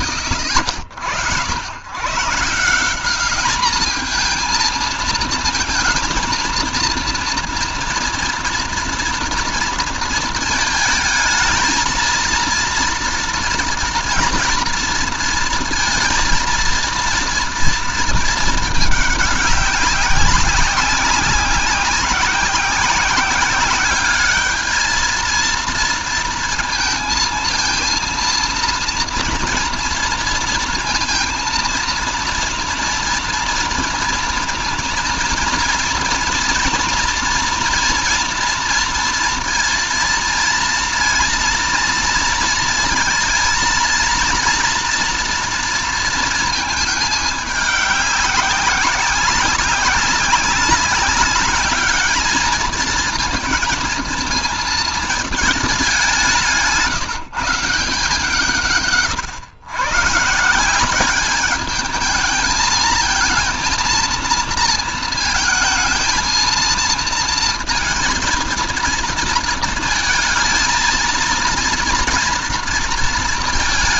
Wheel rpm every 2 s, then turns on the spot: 70, 190, 220, 240, 230, 220, 230, 230, 230, 210, 190, 190, 220, 230, 230, 230, 230, 230, 230, 230, 230, 230, 240, 210, 190, 200, 220, 220, 170, 130, 200, 230, 230, 230, 230, 230, 230.
none